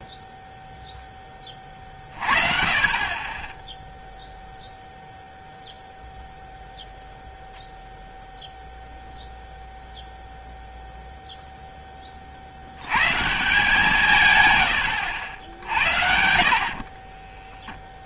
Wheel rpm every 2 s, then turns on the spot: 0, 50, 0, 0, 0, 0, 70, 120, 50.
none